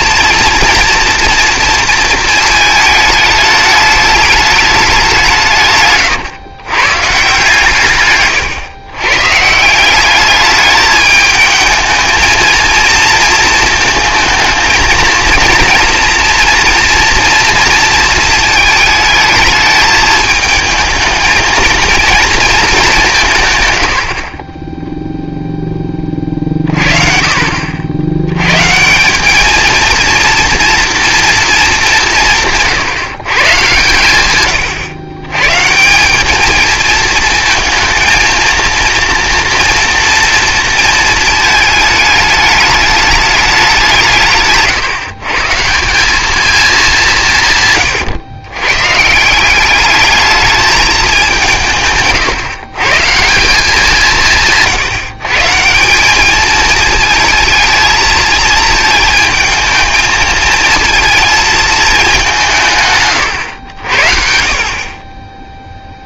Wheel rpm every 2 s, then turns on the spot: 230, 220, 200, 130, 130, 210, 230, 230, 240, 220, 220, 200, 10, 50, 150, 240, 150, 120, 220, 230, 230, 210, 140, 200, 130, 210, 150, 150, 230, 220, 230, 140, 40.
none